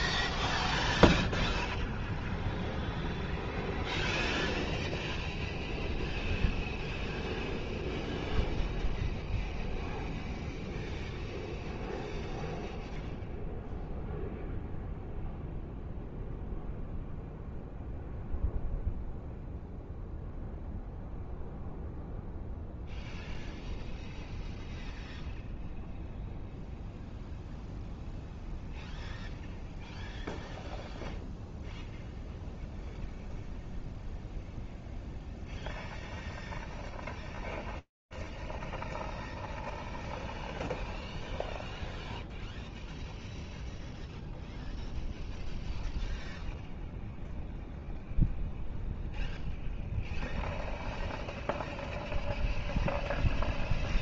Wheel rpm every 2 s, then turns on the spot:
0, 0, 0, 0, 0, 0, 0, 0, 0, 0, 0, 0, 0, 0, 0, 0, 0, 0, 0, 0, 0, 0, 0, 0, 0, 0, 0.
none